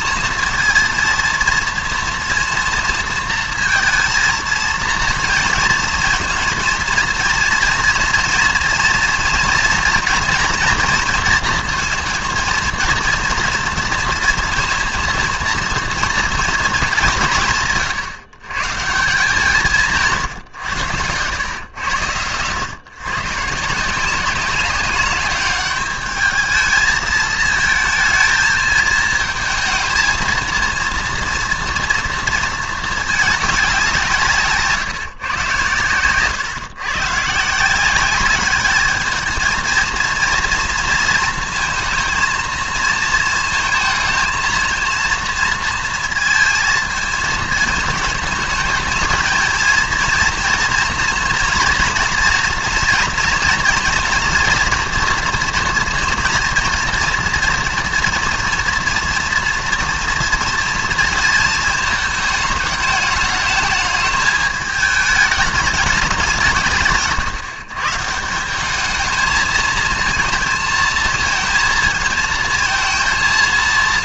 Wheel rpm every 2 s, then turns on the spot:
230, 230, 230, 230, 240, 230, 230, 230, 220, 140, 120, 110, 190, 210, 220, 230, 230, 160, 130, 210, 230, 230, 230, 220, 220, 230, 240, 240, 230, 230, 230, 220, 210, 160, 190, 220, 230.
none